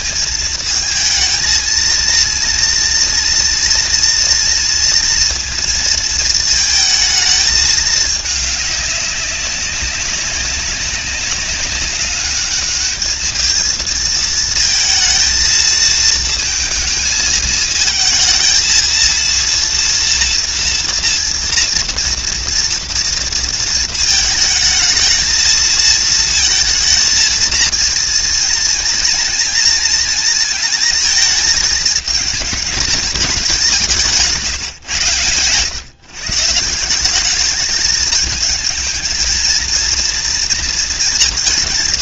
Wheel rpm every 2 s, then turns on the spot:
220, 230, 230, 220, 200, 200, 210, 220, 220, 230, 230, 230, 220, 220, 230, 220, 220, 120, 180, 220, 230.
none